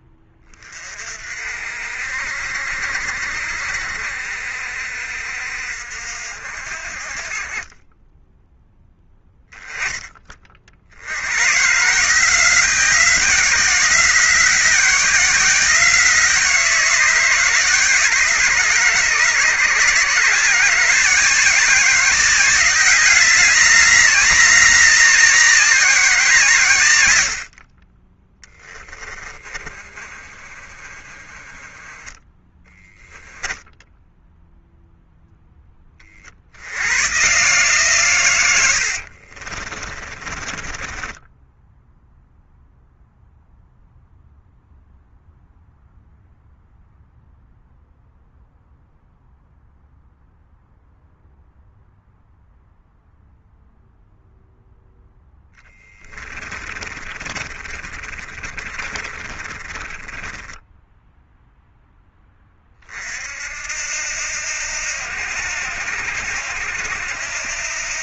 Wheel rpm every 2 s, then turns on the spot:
60, 70, 60, 20, 30, 170, 180, 170, 160, 160, 190, 200, 170, 10, 20, 10, 0, 20, 130, 30, 0, 0, 0, 0, 0, 0, 0, 10, 30, 30, 0, 70, 80, 80.
28-30 38-40 54-60